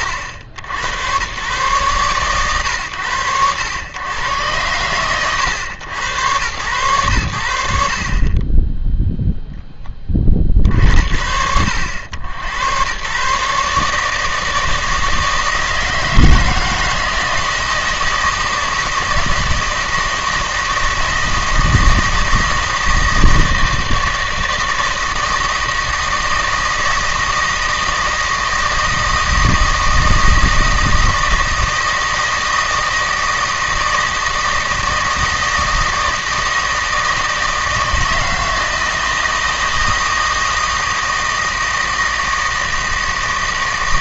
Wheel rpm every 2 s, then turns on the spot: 80, 110, 120, 100, 10, 60, 110, 160, 160, 160, 160, 160, 160, 160, 160, 160, 160, 160, 160, 160, 160, 160.
none